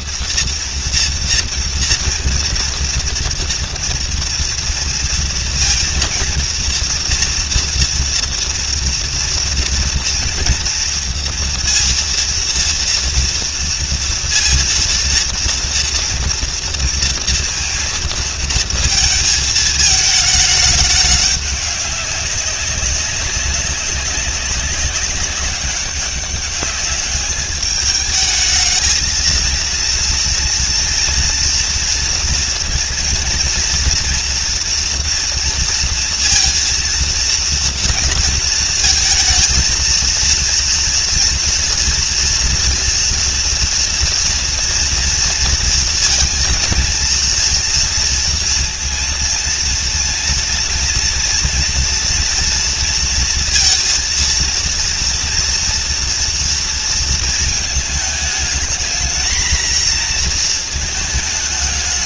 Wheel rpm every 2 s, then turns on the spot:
230, 230, 230, 230, 230, 230, 230, 230, 230, 220, 210, 190, 200, 210, 220, 230, 230, 230, 230, 230, 230, 230, 230, 230, 230, 240, 230, 230, 230, 220, 230.
none